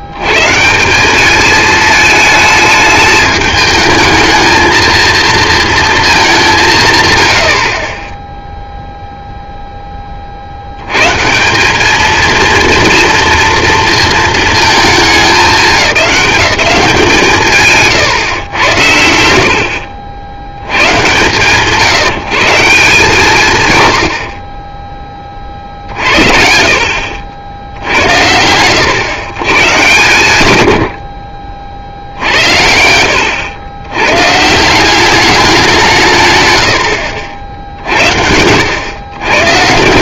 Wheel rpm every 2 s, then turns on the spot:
200, 220, 220, 110, 0, 90, 230, 220, 180, 80, 110, 160, 10, 50, 110, 80, 80, 180, 90, 110.
none